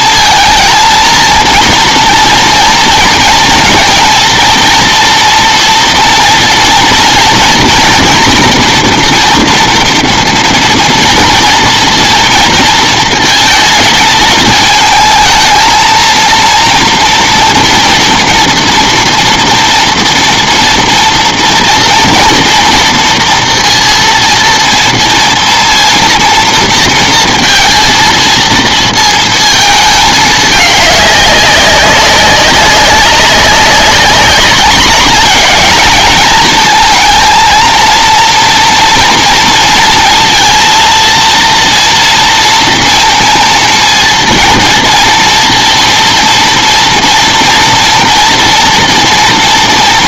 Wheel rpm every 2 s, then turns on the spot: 230, 230, 230, 230, 230, 230, 220, 220, 230, 230, 230, 230, 230, 230, 230, 210, 200, 210, 230, 230, 230, 230, 230, 230, 230.
none